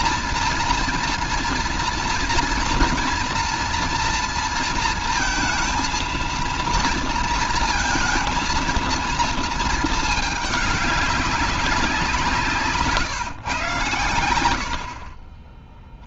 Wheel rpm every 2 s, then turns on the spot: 230, 230, 230, 230, 230, 210, 170, 90.
none